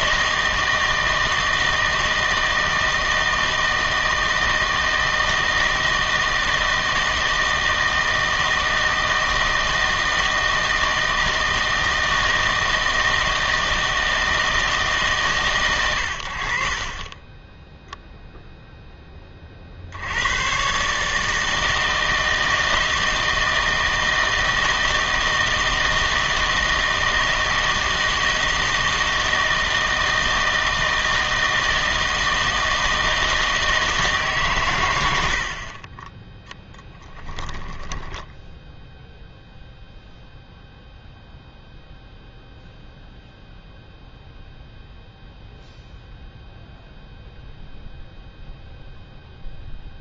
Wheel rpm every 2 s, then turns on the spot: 160, 160, 160, 160, 160, 160, 160, 160, 60, 0, 120, 160, 160, 160, 160, 160, 160, 120, 10, 0, 0, 0, 0, 0, 0.
none